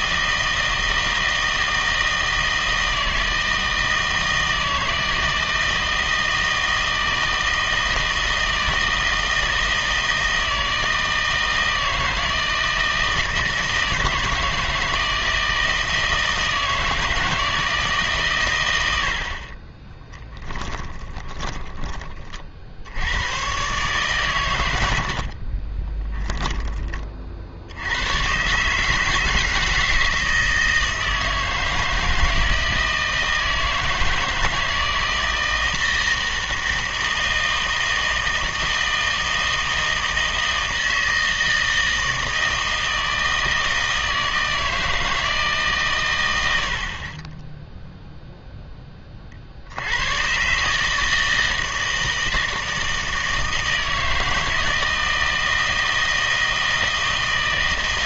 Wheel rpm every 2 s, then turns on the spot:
160, 160, 160, 160, 160, 160, 160, 160, 160, 90, 10, 60, 90, 20, 140, 160, 160, 160, 160, 160, 160, 160, 160, 70, 10, 140, 160, 160, 160.
20-22